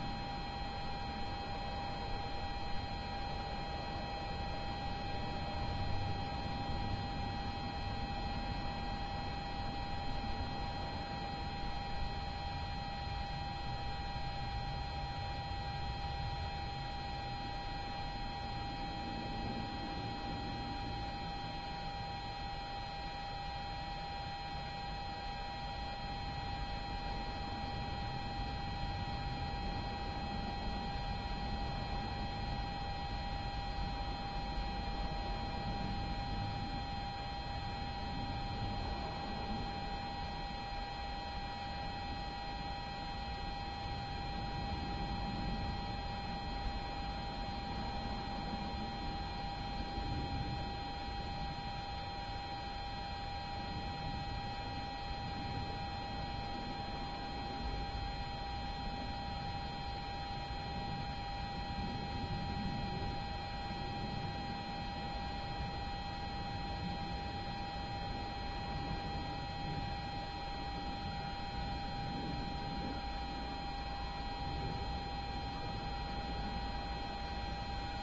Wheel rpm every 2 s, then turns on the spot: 0, 0, 0, 0, 0, 0, 0, 0, 0, 0, 0, 0, 0, 0, 0, 0, 0, 0, 0, 0, 0, 0, 0, 0, 0, 0, 0, 0, 0, 0, 0, 0, 0, 0, 0, 0, 0, 0, 0.
none